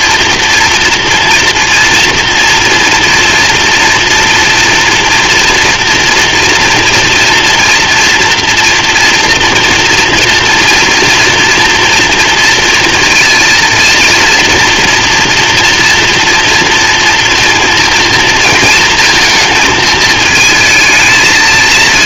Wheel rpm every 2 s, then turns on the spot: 230, 240, 230, 230, 230, 230, 230, 230, 230, 220, 220.
none